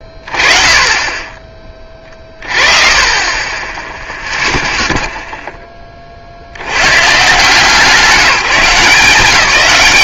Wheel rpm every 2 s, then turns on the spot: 30, 30, 0, 70, 160.
none